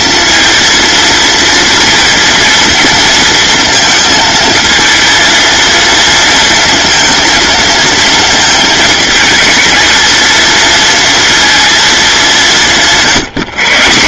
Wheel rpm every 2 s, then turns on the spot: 230, 230, 230, 230, 220, 230, 170.
none